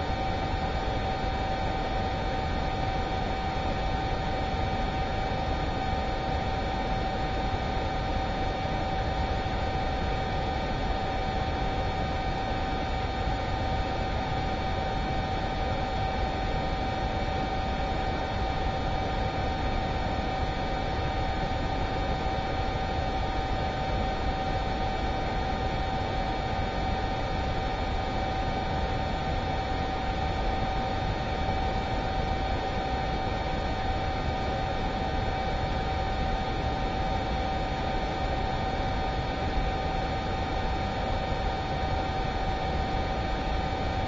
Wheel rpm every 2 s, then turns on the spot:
0, 0, 0, 0, 0, 0, 0, 0, 0, 0, 0, 0, 0, 0, 0, 0, 0, 0, 0, 0, 0, 0.
none